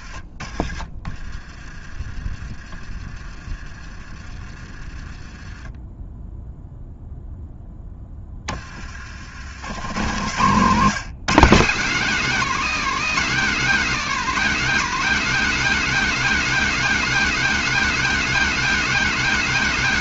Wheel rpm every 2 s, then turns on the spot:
30, 30, 30, 0, 40, 170, 240, 240, 260, 250.
none